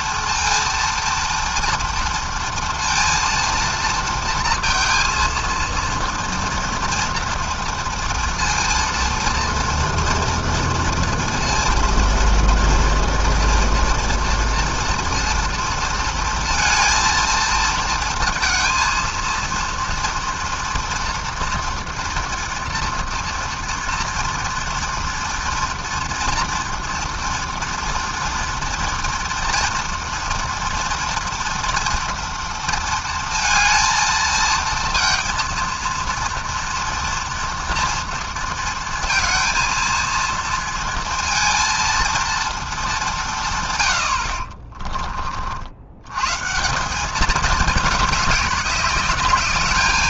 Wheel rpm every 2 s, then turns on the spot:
230, 230, 230, 230, 240, 230, 230, 230, 220, 230, 230, 230, 230, 230, 230, 230, 230, 230, 230, 230, 230, 170, 40, 200, 210.
none